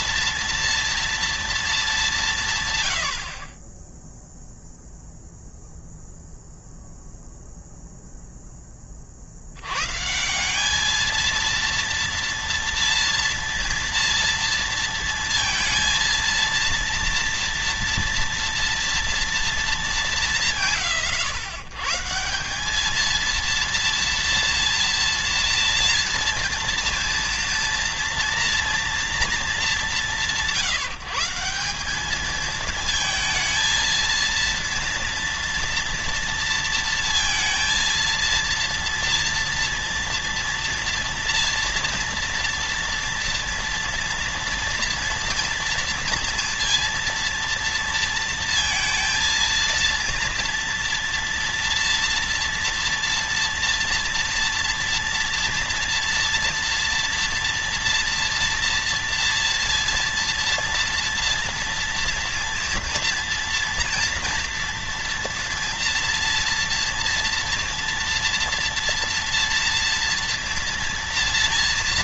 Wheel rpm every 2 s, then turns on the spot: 230, 90, 0, 0, 30, 210, 230, 230, 230, 230, 130, 210, 230, 230, 230, 160, 220, 230, 230, 230, 230, 230, 230, 230, 230, 230, 230, 240, 240, 230, 240, 230, 240, 230, 230, 230.
none